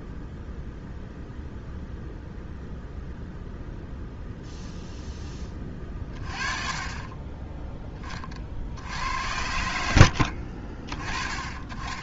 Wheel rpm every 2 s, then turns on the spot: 0, 0, 0, 20, 50, 50.
10-12